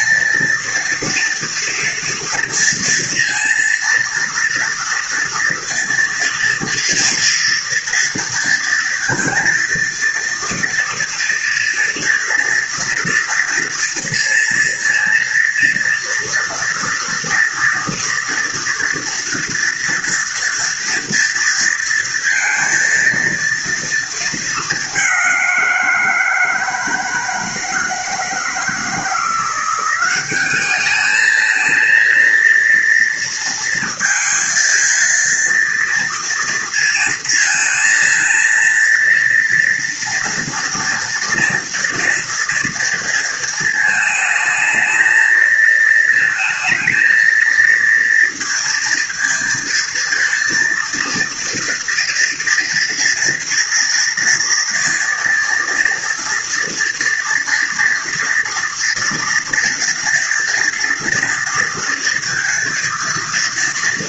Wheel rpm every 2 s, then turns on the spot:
230, 230, 230, 230, 230, 230, 230, 230, 230, 230, 230, 230, 210, 170, 160, 200, 230, 230, 230, 230, 230, 230, 220, 220, 230, 230, 230, 230, 230, 230, 230, 230.
none